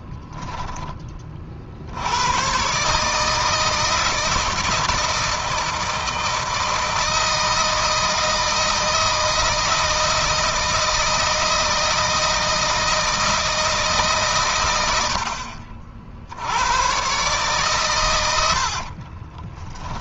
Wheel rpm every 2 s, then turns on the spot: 10, 140, 160, 160, 160, 160, 160, 110, 110, 50.
18-20